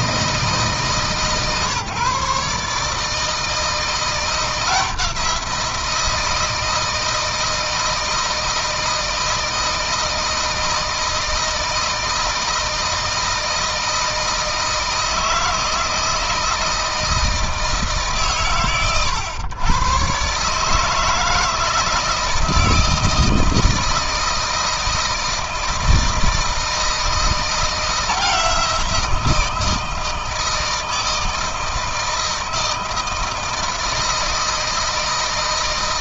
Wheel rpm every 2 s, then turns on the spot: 150, 150, 170, 160, 160, 160, 160, 160, 160, 120, 150, 160, 160, 160, 170, 160, 160, 160.
none